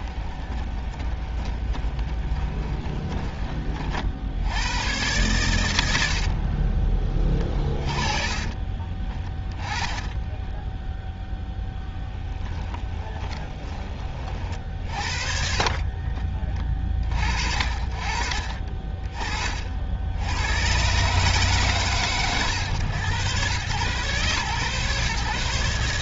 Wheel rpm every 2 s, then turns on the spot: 10, 20, 90, 30, 10, 0, 30, 50, 50, 30, 140, 110, 130.
0-2 6-8 12-14